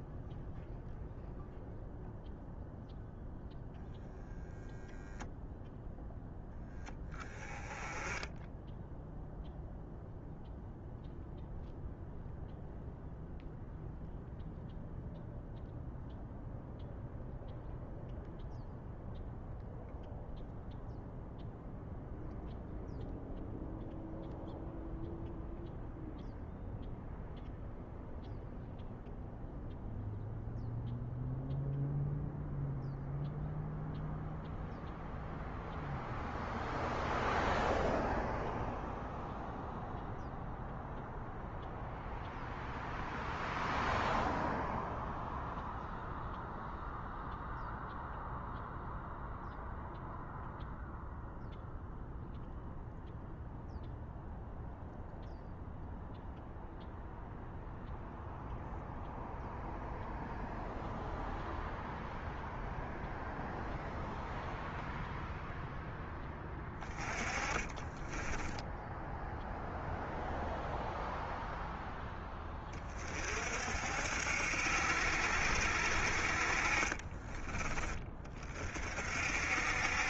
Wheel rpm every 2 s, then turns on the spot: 0, 0, 0, 10, 0, 0, 0, 0, 0, 0, 0, 0, 0, 0, 0, 0, 0, 0, 0, 0, 0, 0, 0, 0, 0, 0, 0, 0, 0, 0, 0, 0, 0, 20, 10, 0, 30, 70, 40, 40.
66-68